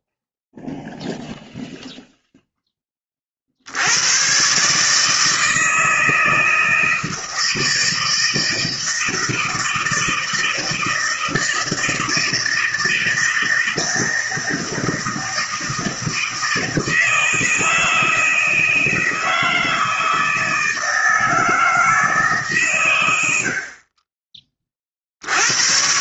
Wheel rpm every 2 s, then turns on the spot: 0, 30, 150, 160, 160, 160, 160, 160, 160, 160, 160, 100, 60.
none